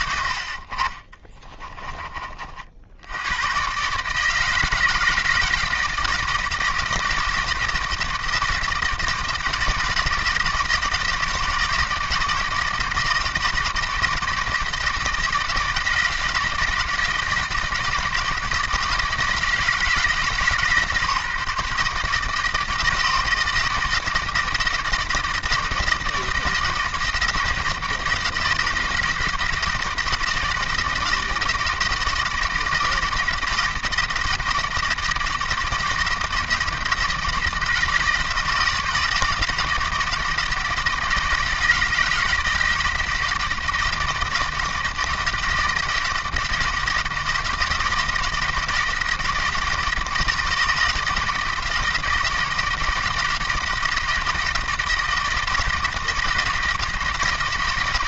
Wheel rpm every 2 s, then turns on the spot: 50, 70, 160, 160, 160, 160, 160, 160, 160, 160, 150, 160, 160, 160, 160, 170, 160, 170, 160, 170, 170, 160, 160, 160, 160, 160, 160, 160, 160.
none